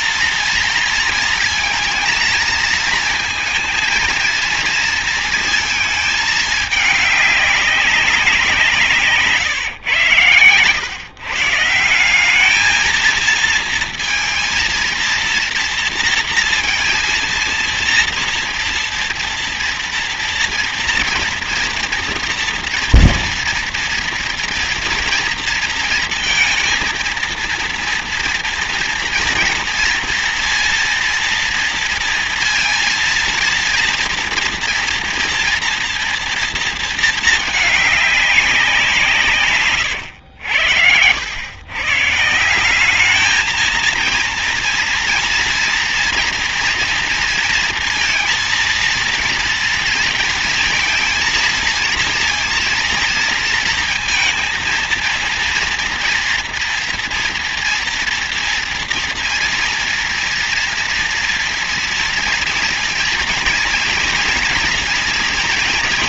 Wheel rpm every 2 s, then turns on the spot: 230, 230, 230, 220, 190, 120, 200, 230, 230, 230, 230, 230, 230, 230, 230, 230, 230, 230, 230, 190, 100, 160, 230, 230, 230, 230, 230, 230, 230, 230, 230, 230, 240.
none